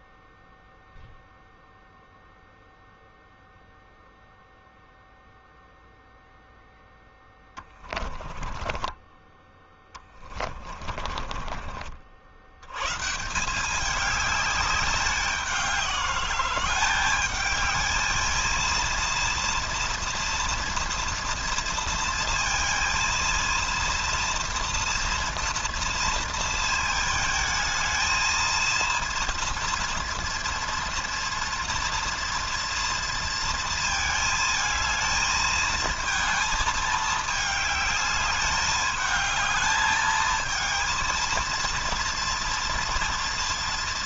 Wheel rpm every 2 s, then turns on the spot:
0, 0, 0, 10, 20, 40, 120, 200, 200, 230, 240, 230, 230, 220, 230, 230, 230, 220, 220, 210, 230, 230.
6-8 10-12